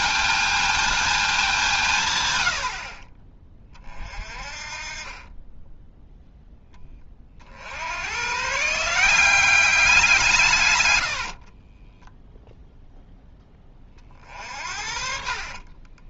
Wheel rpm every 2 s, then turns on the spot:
220, 60, 30, 10, 160, 120, 0, 50.
none